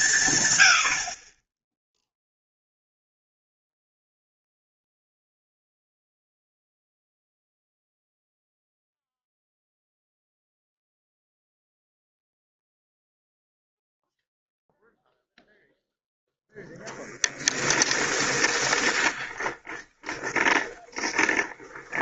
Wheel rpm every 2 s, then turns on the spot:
90, 0, 0, 0, 0, 0, 0, 0, 0, 20, 20.
18-22